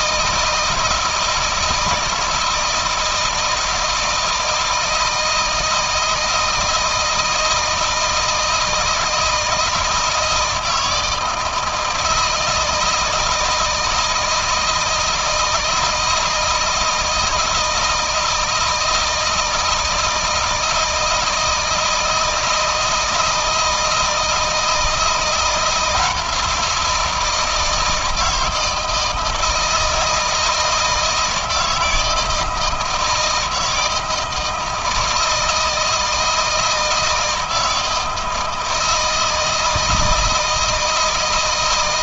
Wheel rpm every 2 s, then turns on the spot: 160, 160, 160, 160, 160, 160, 160, 160, 160, 160, 160, 170, 170, 170, 160, 160, 160, 160, 160, 160, 160.
none